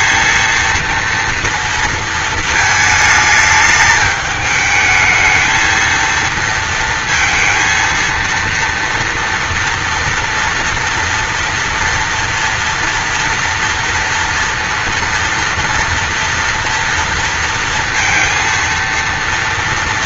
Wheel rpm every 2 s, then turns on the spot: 230, 220, 220, 230, 230, 230, 240, 230, 230, 230.
none